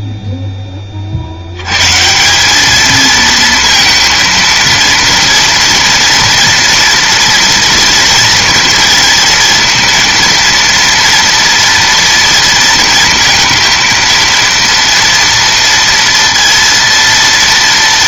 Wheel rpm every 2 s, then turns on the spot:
20, 210, 230, 230, 230, 230, 230, 230, 230.
none